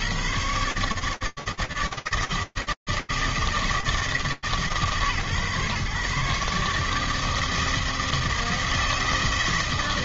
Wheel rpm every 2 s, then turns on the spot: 80, 160, 150, 150, 160.
none